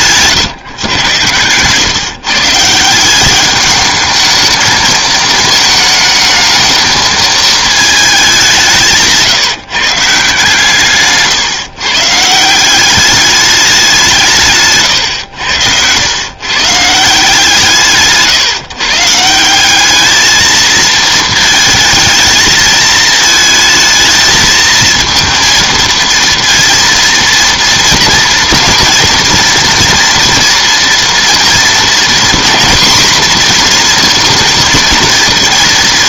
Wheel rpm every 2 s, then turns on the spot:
150, 160, 220, 220, 190, 150, 190, 140, 110, 130, 220, 220, 220, 230, 230, 230, 240, 230.
none